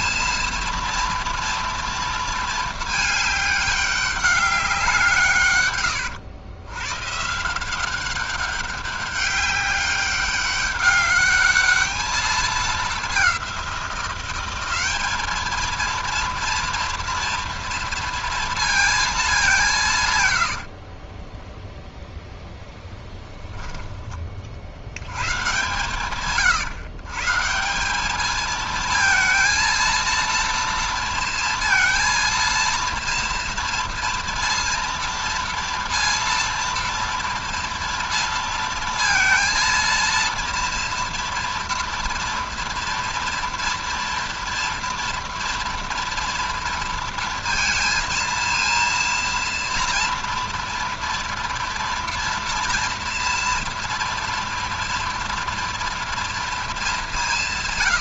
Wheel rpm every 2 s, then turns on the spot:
230, 220, 190, 120, 200, 200, 210, 190, 240, 230, 100, 0, 40, 130, 220, 230, 230, 230, 230, 230, 230, 230, 230, 230, 230, 230, 240, 230, 230.
20-22